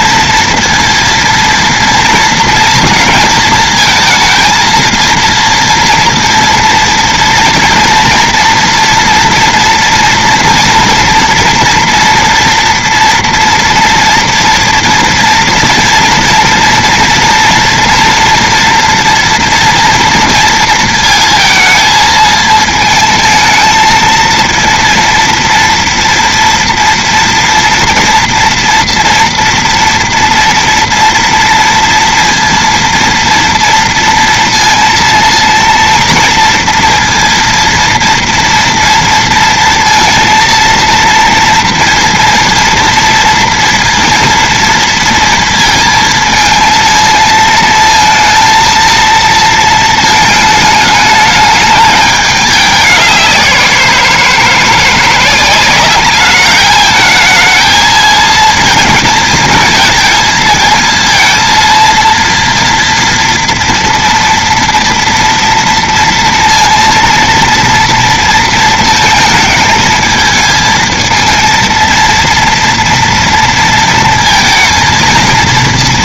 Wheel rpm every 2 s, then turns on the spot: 230, 230, 220, 230, 230, 230, 230, 230, 230, 240, 230, 220, 230, 230, 230, 230, 230, 230, 230, 230, 230, 230, 230, 230, 230, 220, 210, 170, 210, 220, 230, 230, 230, 230, 230, 220, 230, 230.
none